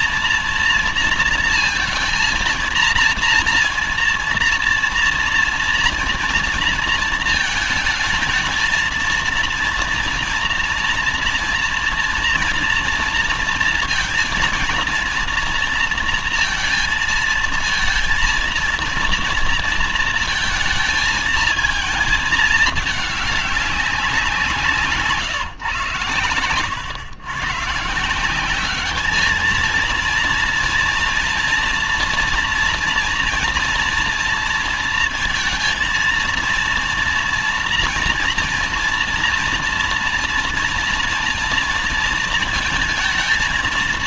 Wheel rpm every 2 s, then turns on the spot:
230, 230, 230, 230, 230, 230, 240, 230, 230, 230, 230, 220, 170, 110, 190, 230, 230, 230, 230, 230, 230, 230.
none